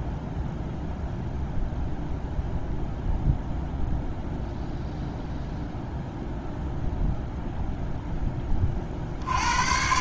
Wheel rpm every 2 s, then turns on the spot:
0, 0, 0, 0, 30.
none